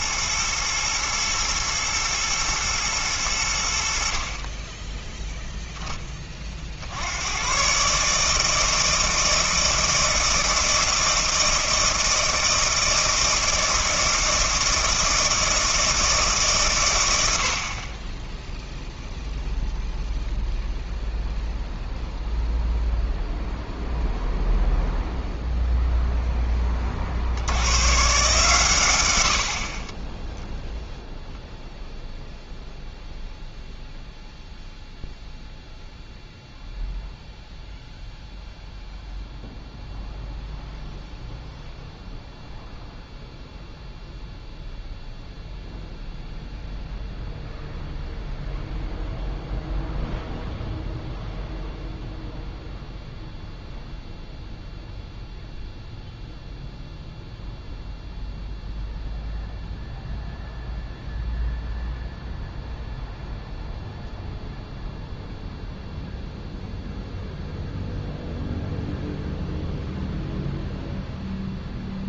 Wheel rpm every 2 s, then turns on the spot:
110, 110, 20, 50, 160, 160, 160, 160, 130, 0, 0, 0, 0, 20, 120, 0, 0, 0, 0, 0, 0, 0, 0, 0, 0, 0, 0, 0, 0, 0, 0, 0, 0, 0, 0, 0.
none